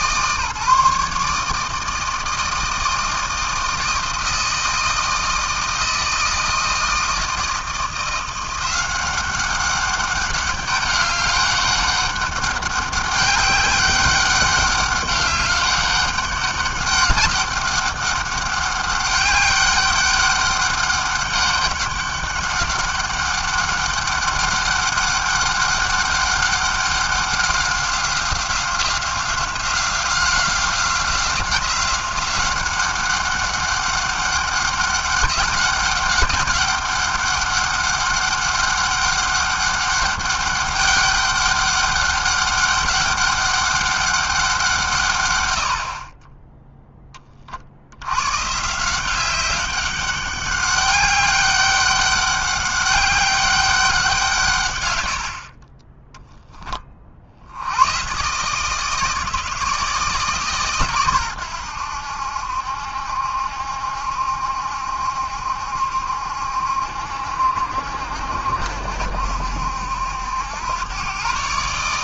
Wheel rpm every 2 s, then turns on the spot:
150, 160, 160, 160, 190, 200, 190, 200, 200, 200, 200, 200, 200, 200, 180, 180, 200, 200, 200, 200, 200, 200, 120, 30, 180, 200, 200, 60, 60, 160, 110, 70, 70, 70, 70, 130.
none